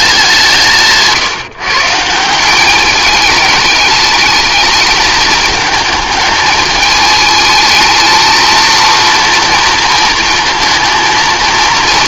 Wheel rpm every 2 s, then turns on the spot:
160, 200, 220, 210, 230, 220.
0-2